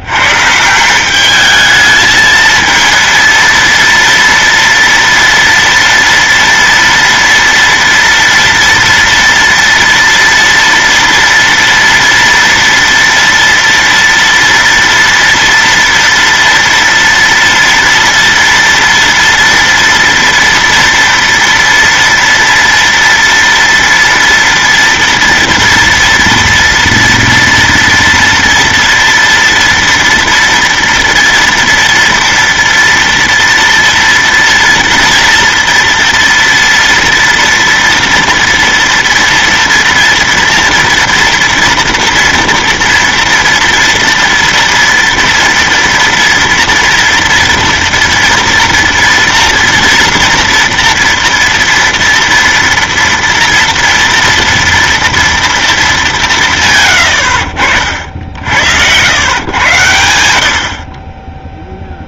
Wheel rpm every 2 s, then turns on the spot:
150, 220, 240, 230, 230, 230, 230, 230, 230, 230, 230, 230, 230, 230, 240, 240, 230, 240, 230, 230, 230, 230, 230, 230, 240, 240, 230, 230, 160, 70, 70.
none